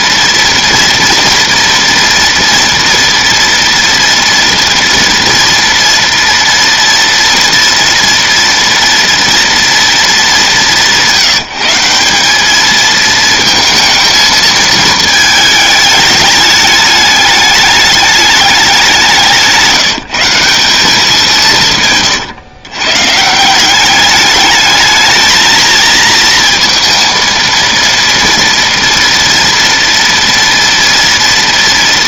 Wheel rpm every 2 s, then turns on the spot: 230, 230, 230, 230, 230, 170, 220, 220, 210, 190, 190, 140, 220, 230, 230, 230.
none